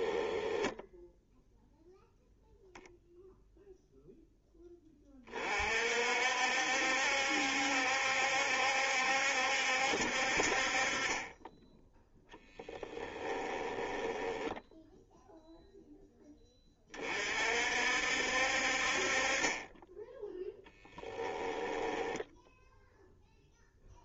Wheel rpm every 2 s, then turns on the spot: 10, 0, 20, 70, 70, 40, 10, 0, 20, 50, 10, 0.
0-2 12-14 20-22